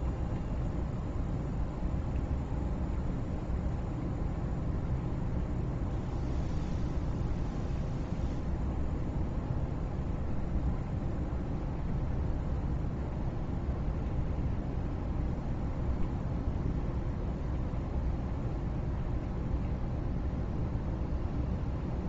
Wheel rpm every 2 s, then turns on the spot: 0, 0, 0, 0, 0, 0, 0, 0, 0, 0, 0.
none